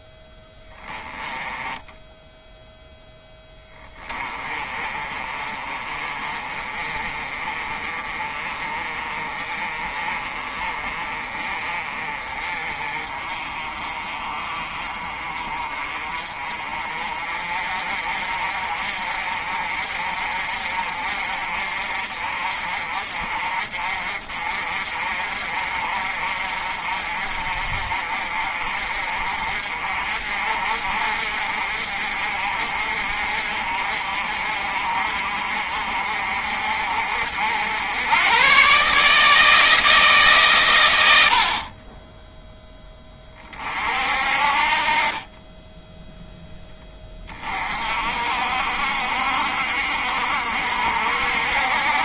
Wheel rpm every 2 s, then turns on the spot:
10, 0, 30, 30, 30, 30, 40, 40, 40, 50, 50, 50, 50, 50, 50, 50, 50, 50, 70, 150, 70, 20, 30, 30, 60, 60.
none